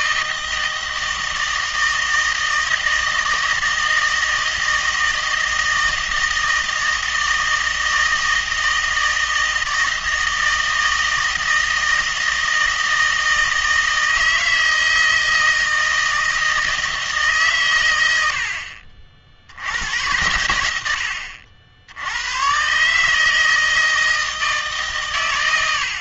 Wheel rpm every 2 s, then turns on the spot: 160, 160, 160, 160, 160, 160, 160, 160, 160, 60, 100, 130, 150.
none